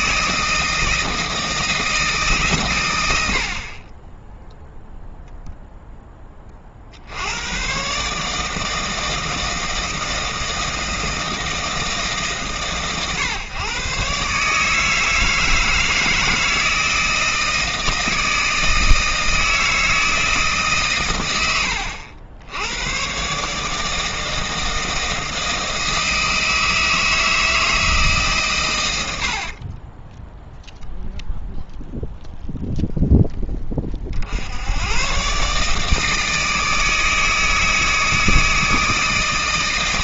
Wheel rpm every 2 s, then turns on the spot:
160, 150, 0, 30, 150, 160, 140, 140, 160, 160, 150, 90, 160, 160, 130, 0, 0, 80, 160, 160.
none